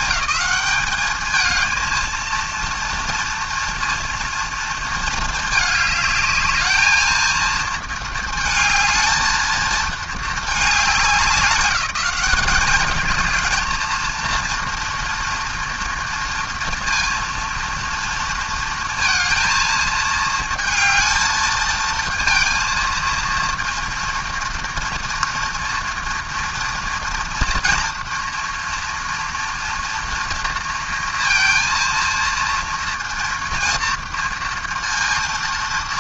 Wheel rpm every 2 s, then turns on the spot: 210, 230, 230, 220, 220, 210, 220, 230, 230, 230, 220, 230, 230, 230, 230, 230, 230, 230.
none